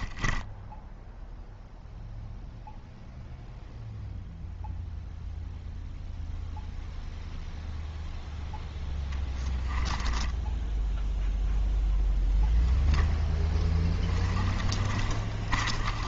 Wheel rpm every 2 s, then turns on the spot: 10, 0, 0, 0, 0, 0, 0, 30.
0-2 14-16